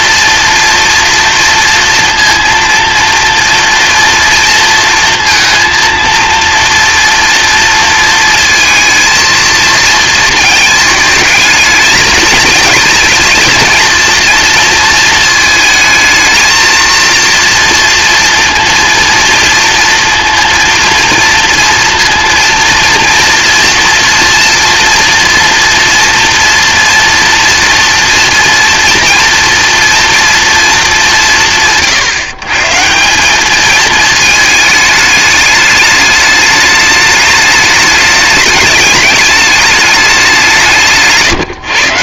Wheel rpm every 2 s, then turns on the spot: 230, 230, 230, 230, 230, 220, 220, 230, 230, 230, 230, 230, 240, 230, 230, 210, 150, 220, 210, 210, 170.
none